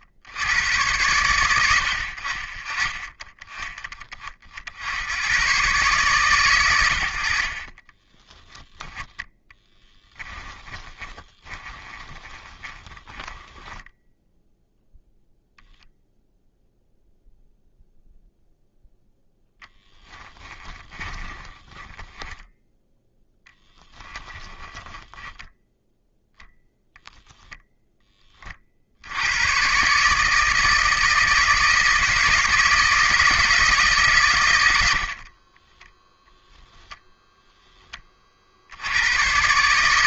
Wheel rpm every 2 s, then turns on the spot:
100, 40, 70, 100, 10, 20, 20, 0, 0, 0, 20, 0, 10, 0, 60, 160, 160, 80, 0, 80.
10-14 20-22 24-26